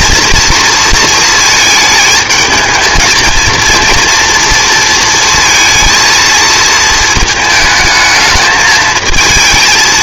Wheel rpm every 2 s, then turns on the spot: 230, 220, 230, 220, 220.
none